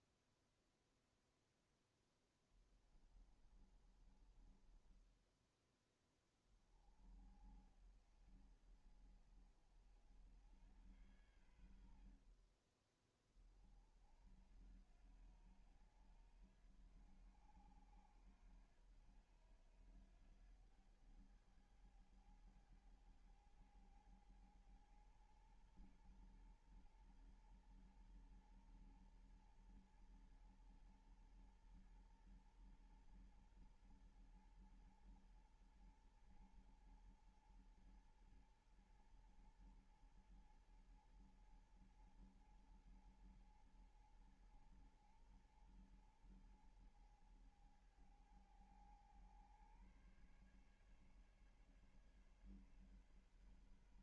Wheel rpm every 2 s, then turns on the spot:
0, 0, 20, 10, 60, 70, 60, 50, 90, 90, 90, 100, 110, 110, 120, 110, 120, 120, 120, 120, 120, 110, 110, 110, 110, 120, 140.
4-6